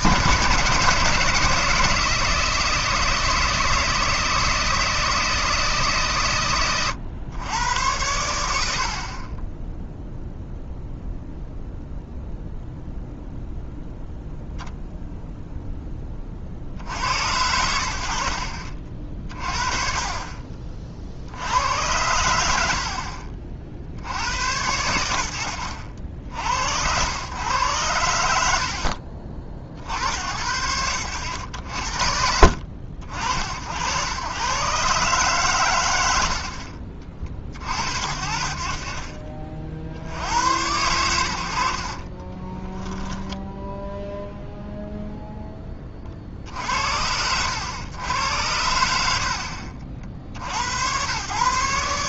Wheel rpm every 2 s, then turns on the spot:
140, 170, 160, 110, 70, 0, 0, 0, 60, 50, 40, 70, 90, 80, 70, 90, 60, 130, 50, 40, 90, 10, 0, 70, 80, 90.
28-30 42-44